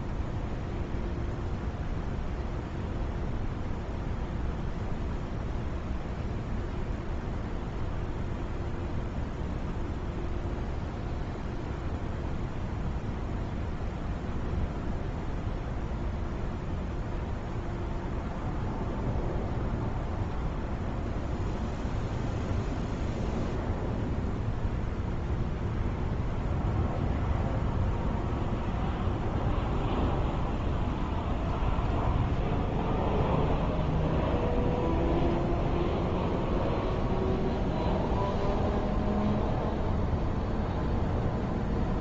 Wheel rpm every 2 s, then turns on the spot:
0, 0, 0, 0, 0, 0, 0, 0, 0, 0, 0, 0, 0, 0, 0, 0, 0, 0, 0, 0, 0.
none